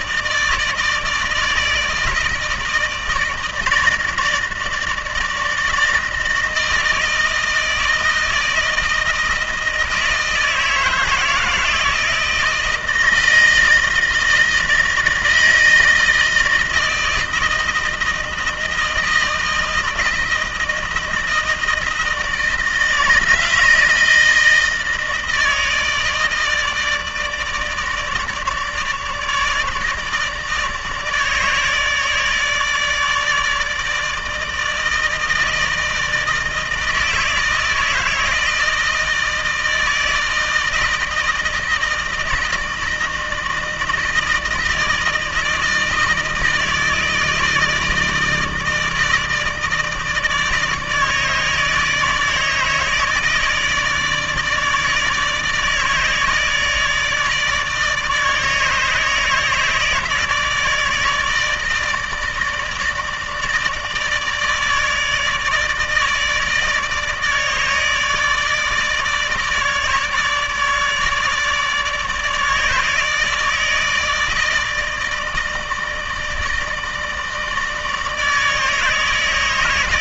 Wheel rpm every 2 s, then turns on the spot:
160, 160, 160, 160, 160, 160, 160, 160, 160, 160, 160, 160, 160, 160, 150, 160, 150, 160, 160, 160, 160, 160, 160, 160, 160, 160, 160, 160, 160, 150, 160, 160, 160, 160, 150, 150, 160, 160, 160, 160.
none